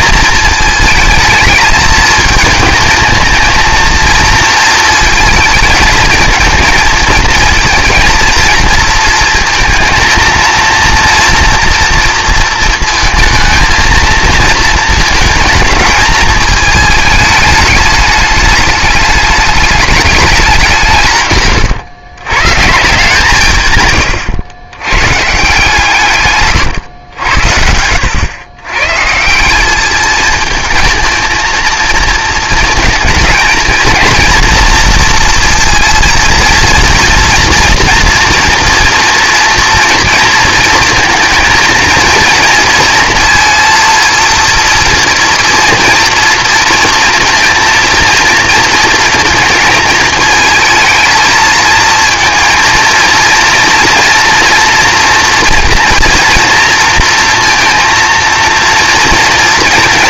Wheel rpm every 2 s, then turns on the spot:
220, 220, 230, 230, 230, 230, 230, 230, 220, 210, 190, 140, 100, 120, 110, 220, 220, 230, 230, 230, 230, 230, 230, 230, 230, 220, 220, 240, 240, 230.
none